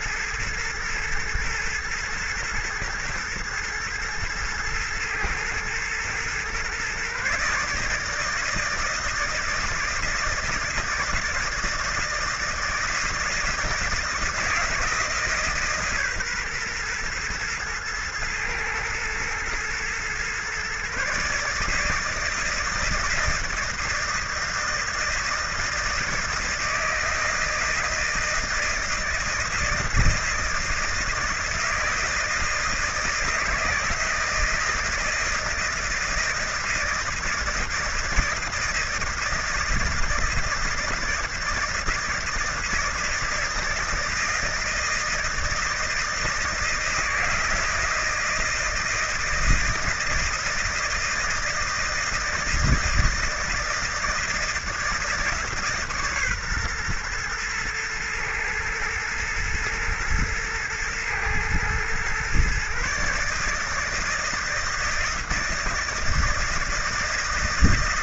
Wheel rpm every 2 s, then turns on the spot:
120, 110, 110, 120, 160, 160, 160, 170, 130, 110, 130, 160, 160, 160, 160, 160, 160, 160, 160, 160, 160, 160, 160, 160, 160, 160, 160, 160, 130, 110, 110, 130, 160, 160.
none